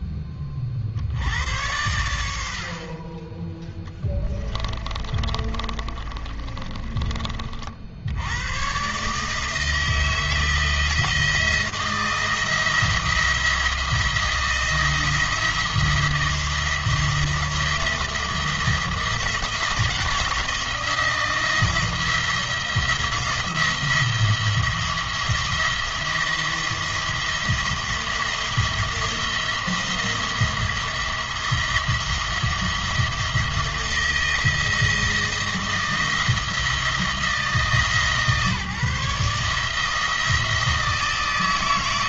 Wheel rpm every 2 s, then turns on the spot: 60, 50, 30, 30, 130, 170, 170, 170, 170, 170, 170, 170, 170, 170, 170, 170, 170, 170, 170, 150, 160.
4-8